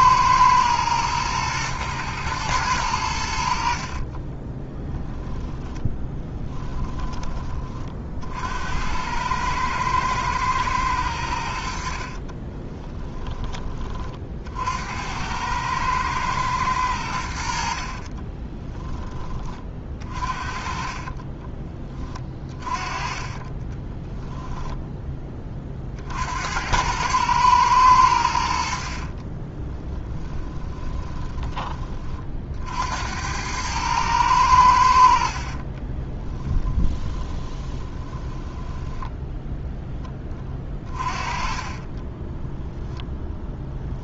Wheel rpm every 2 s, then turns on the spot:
110, 90, 10, 10, 90, 100, 20, 80, 90, 20, 40, 20, 10, 90, 50, 10, 70, 70, 20, 10, 30, 0.
12-14 18-24 28-32 36-42